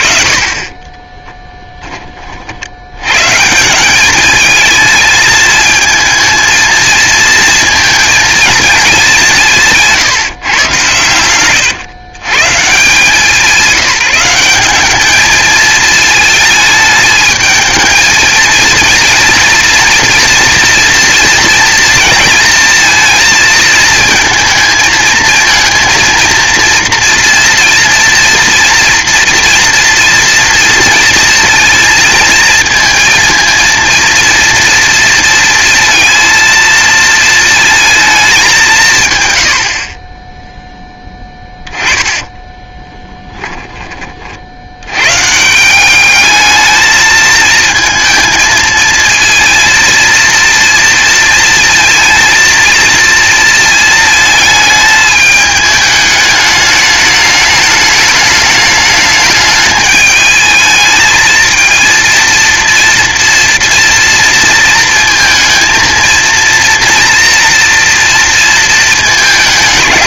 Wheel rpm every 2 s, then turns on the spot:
30, 80, 220, 220, 210, 120, 150, 190, 220, 230, 240, 230, 220, 230, 240, 230, 220, 230, 230, 190, 10, 10, 90, 220, 220, 230, 230, 220, 210, 210, 220, 230, 230, 230, 220.
42-44